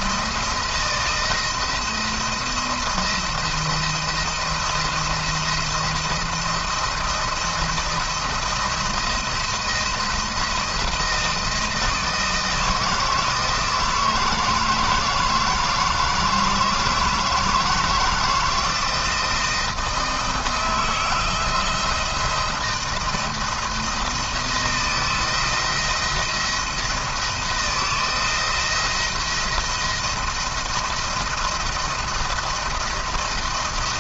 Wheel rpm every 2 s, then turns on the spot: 170, 170, 170, 170, 170, 170, 160, 160, 160, 160, 160, 170, 170, 170, 170, 170, 170.
none